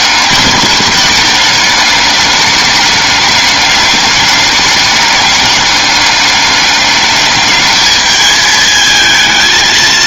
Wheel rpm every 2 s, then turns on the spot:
210, 200, 200, 200, 220.
none